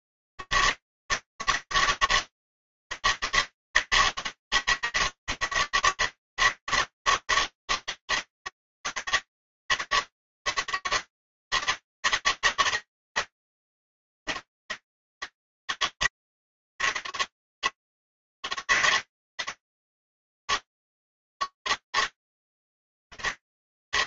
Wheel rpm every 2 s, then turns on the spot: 80, 160, 150, 150, 160, 150, 160, 160, 150, 160, 150, 160.
none